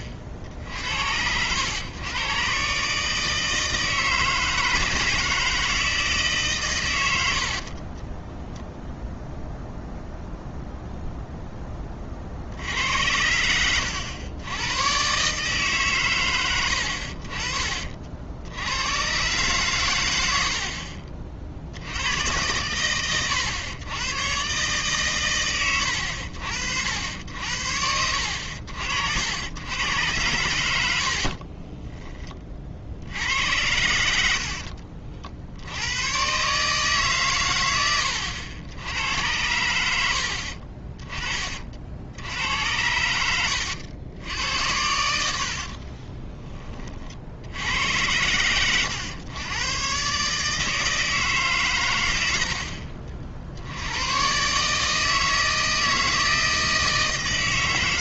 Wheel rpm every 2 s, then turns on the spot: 50, 140, 160, 130, 0, 0, 70, 100, 90, 90, 60, 100, 130, 70, 80, 80, 50, 60, 140, 90, 50, 80, 90, 30, 100, 160, 60, 140, 160.
30-32 34-36 40-42